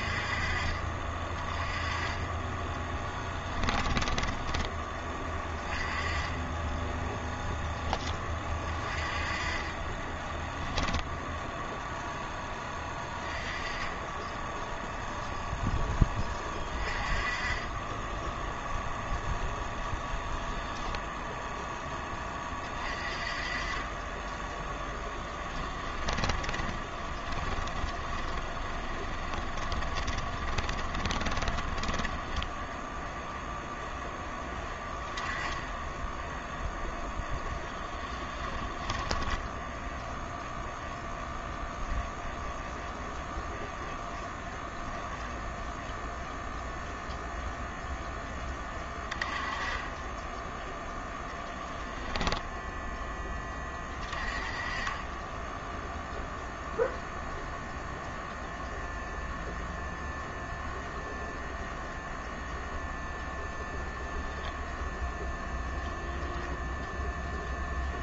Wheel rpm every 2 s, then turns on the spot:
30, 10, 20, 10, 30, 10, 20, 0, 30, 0, 10, 30, 10, 20, 20, 30, 0, 10, 0, 20, 0, 0, 0, 0, 20, 0, 0, 20, 0, 0, 0, 0, 0, 0.
2-4 24-32 38-40